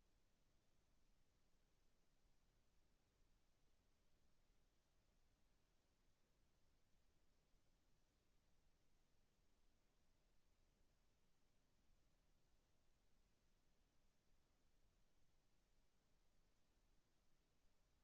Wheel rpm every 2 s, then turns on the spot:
0, 0, 0, 0, 0, 0, 0, 0, 0.
none